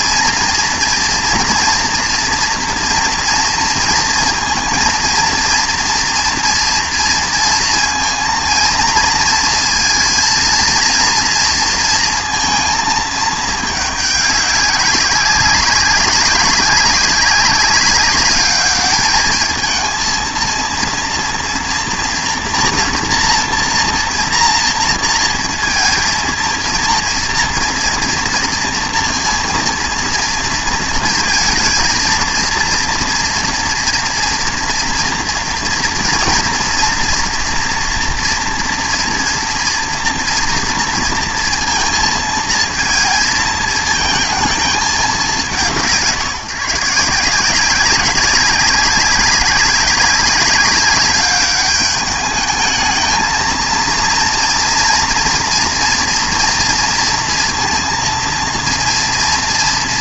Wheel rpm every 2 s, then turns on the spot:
230, 230, 230, 230, 230, 230, 230, 190, 190, 210, 230, 240, 230, 230, 230, 230, 230, 230, 240, 240, 240, 230, 220, 150, 190, 200, 210, 230, 230, 230.
none